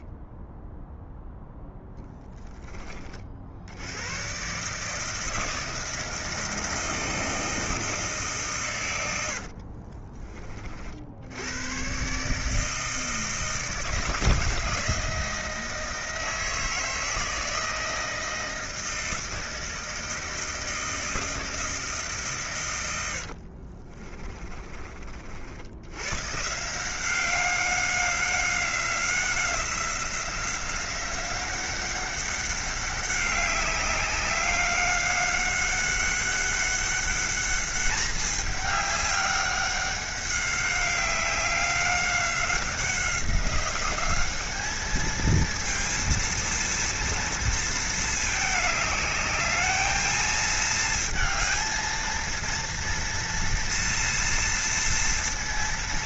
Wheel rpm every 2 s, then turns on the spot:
0, 30, 150, 160, 100, 60, 160, 160, 160, 160, 160, 90, 40, 180, 190, 180, 190, 200, 200, 200, 190, 180, 210, 230, 210, 220, 230, 230.
8-10 22-24